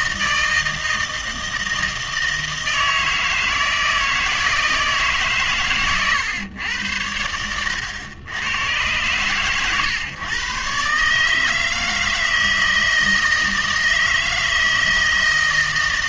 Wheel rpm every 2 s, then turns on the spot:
160, 160, 160, 110, 100, 130, 160, 160.
none